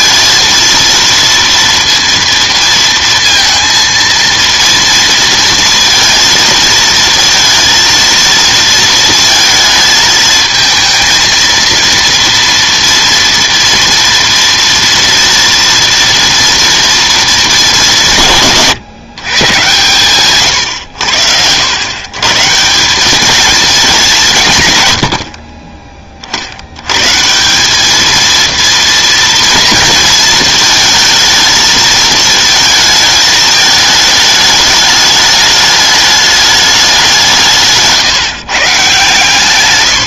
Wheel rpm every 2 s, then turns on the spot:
230, 230, 230, 230, 230, 220, 230, 230, 230, 160, 120, 160, 140, 80, 230, 230, 220, 210, 210, 140.
none